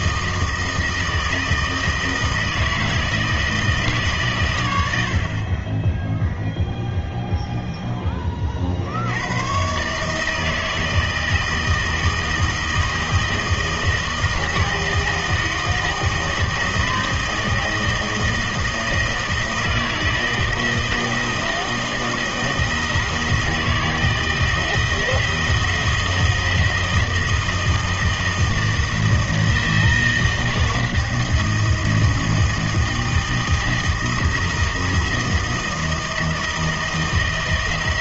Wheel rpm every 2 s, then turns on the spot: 160, 160, 100, 0, 60, 160, 160, 160, 160, 160, 160, 160, 160, 160, 160, 160, 160, 160, 160.
none